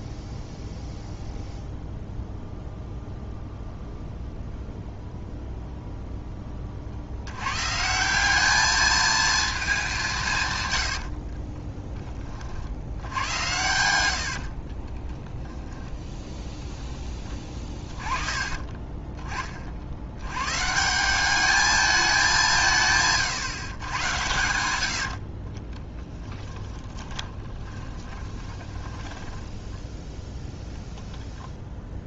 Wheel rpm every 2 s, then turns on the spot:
0, 0, 0, 40, 220, 110, 60, 30, 10, 20, 150, 160, 80, 20, 10, 0.
10-12 14-16 24-30